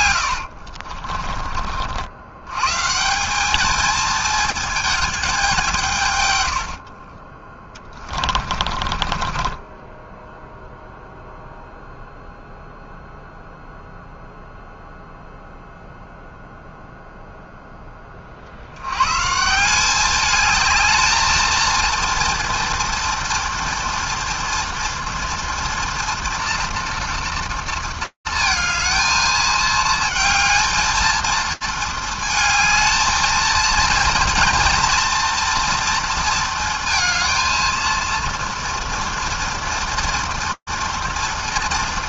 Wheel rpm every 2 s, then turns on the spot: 80, 110, 220, 90, 30, 0, 0, 0, 0, 60, 210, 230, 230, 230, 220, 220, 220, 230, 230, 230, 230.
0-2 8-10